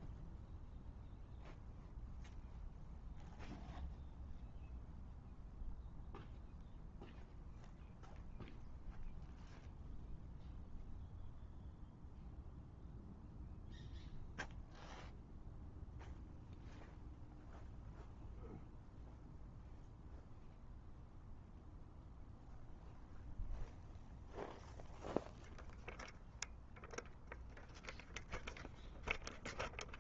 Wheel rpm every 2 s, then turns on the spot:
0, 0, 0, 0, 0, 0, 0, 0, 0, 0, 0, 0, 0, 0, 0.
none